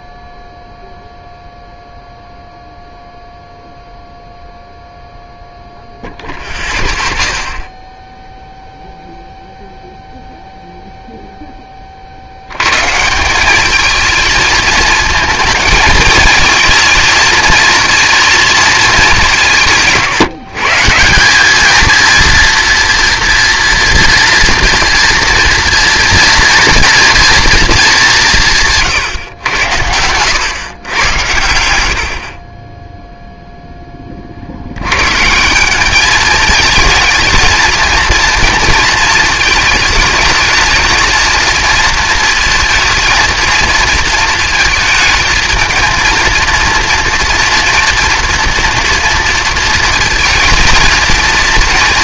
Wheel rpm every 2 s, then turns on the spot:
0, 0, 0, 0, 0, 0, 130, 220, 220, 210, 150, 230, 230, 230, 150, 110, 10, 100, 220, 220, 220, 230, 220, 230, 230, 230.
none